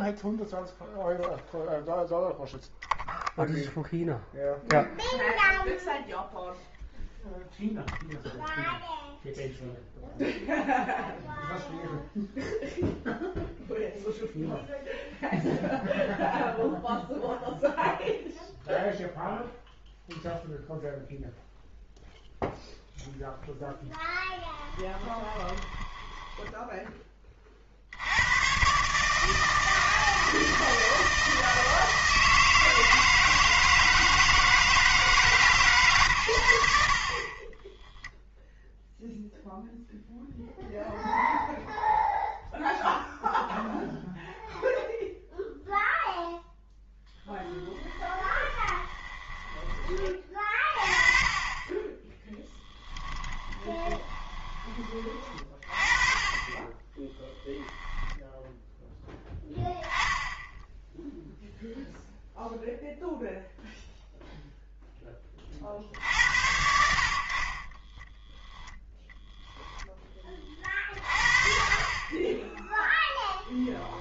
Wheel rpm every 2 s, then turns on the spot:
0, 0, 0, 0, 0, 0, 0, 0, 0, 0, 0, 0, 10, 10, 140, 160, 160, 160, 70, 0, 0, 0, 0, 10, 20, 30, 10, 30, 20, 10, 0, 0, 0, 70, 10, 40, 10.
24-26 48-50 52-54